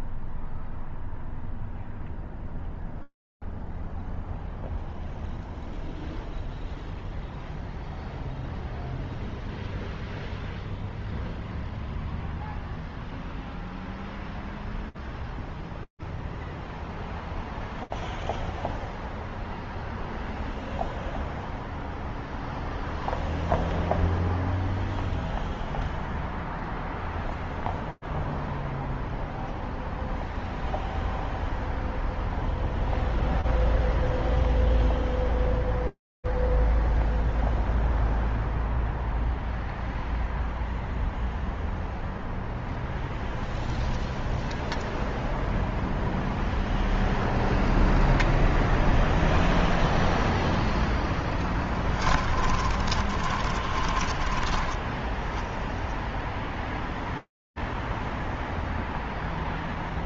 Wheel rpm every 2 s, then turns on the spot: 0, 0, 0, 0, 0, 0, 0, 0, 0, 0, 0, 0, 0, 0, 0, 0, 0, 0, 0, 0, 0, 0, 0, 0, 0, 0, 10, 20, 0, 0.
52-56